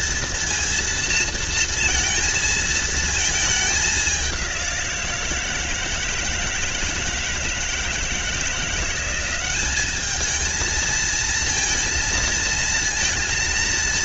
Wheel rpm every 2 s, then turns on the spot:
230, 220, 170, 160, 180, 220, 230.
none